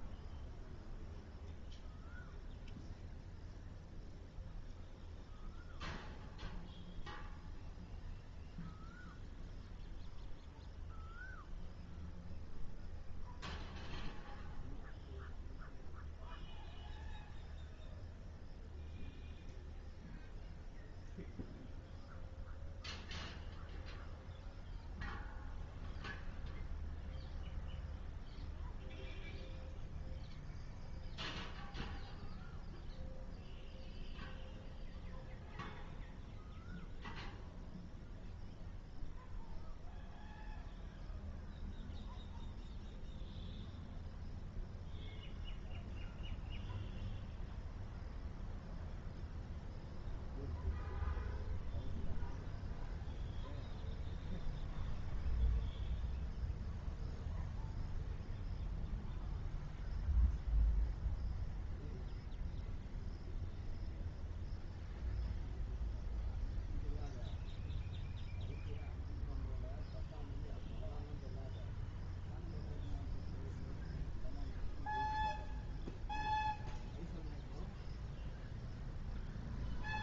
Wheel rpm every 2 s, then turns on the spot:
0, 0, 0, 0, 0, 0, 0, 0, 0, 0, 0, 0, 0, 0, 0, 0, 0, 0, 0, 0, 0, 0, 0, 0, 0, 0, 0, 0, 0, 0, 0, 0, 0, 0, 0, 0, 0, 0, 0, 0.
none